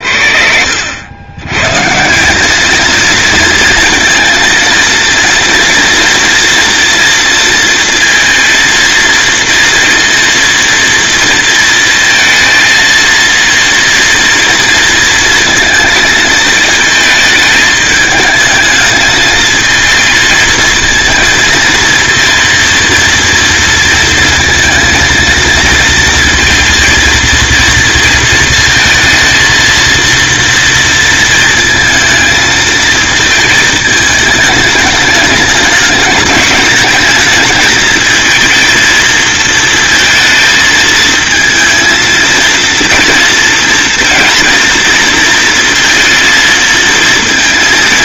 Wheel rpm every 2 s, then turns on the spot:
100, 230, 230, 230, 230, 230, 230, 230, 220, 220, 230, 230, 230, 230, 230, 230, 220, 210, 220, 230, 220, 230, 230, 230.
none